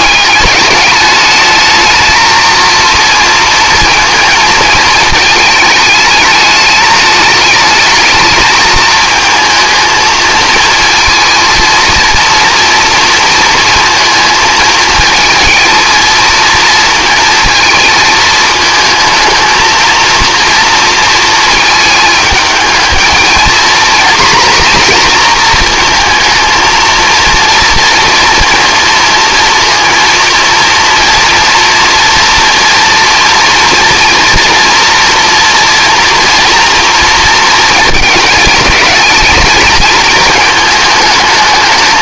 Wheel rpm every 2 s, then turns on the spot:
210, 230, 220, 210, 220, 230, 230, 220, 230, 220, 230, 220, 240, 230, 230, 230, 230, 240, 230, 210, 220.
none